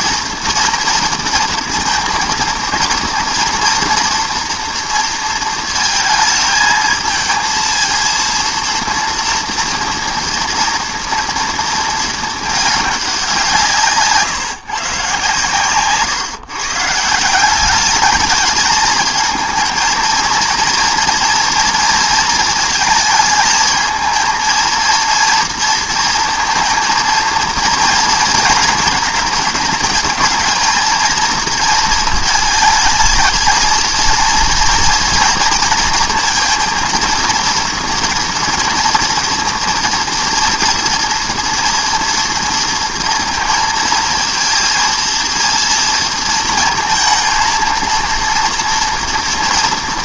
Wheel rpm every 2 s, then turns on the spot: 230, 230, 230, 220, 230, 230, 220, 140, 140, 210, 230, 230, 230, 230, 230, 220, 220, 230, 230, 230, 230, 230, 230, 230, 230.
none